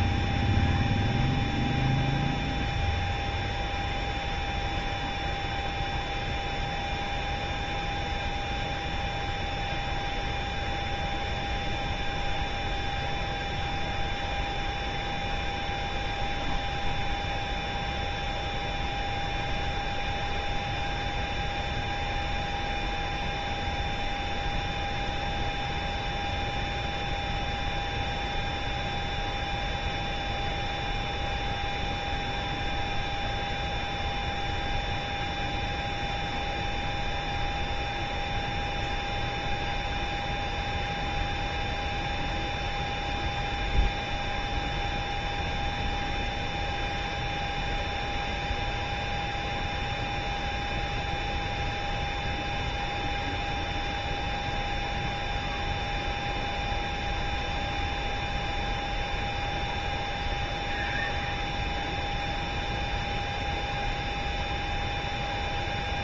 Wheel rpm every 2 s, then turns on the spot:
0, 0, 0, 0, 0, 0, 0, 0, 0, 0, 0, 0, 0, 0, 0, 0, 0, 0, 0, 0, 0, 0, 0, 0, 0, 0, 0, 0, 0, 0, 0, 0, 0.
none